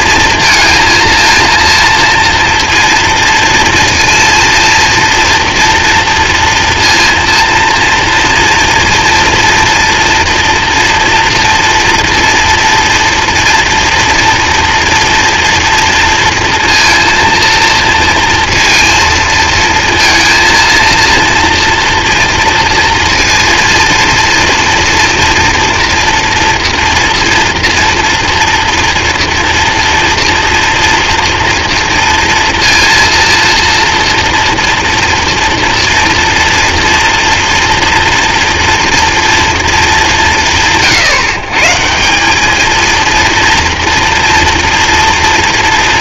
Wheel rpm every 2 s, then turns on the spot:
230, 230, 230, 230, 240, 230, 230, 240, 230, 230, 230, 230, 230, 240, 230, 230, 230, 230, 230, 230, 150, 220, 230.
none